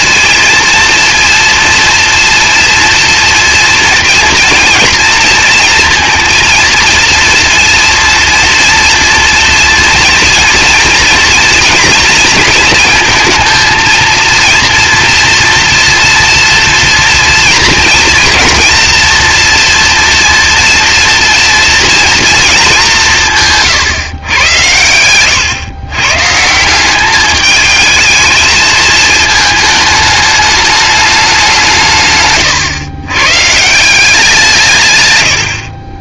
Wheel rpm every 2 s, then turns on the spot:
230, 240, 230, 230, 230, 230, 230, 230, 230, 230, 230, 210, 110, 180, 220, 210, 120, 140.
none